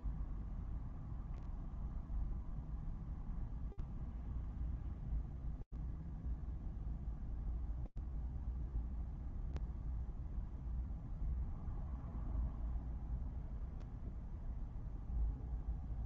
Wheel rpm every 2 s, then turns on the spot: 0, 0, 0, 0, 0, 0, 0, 0.
none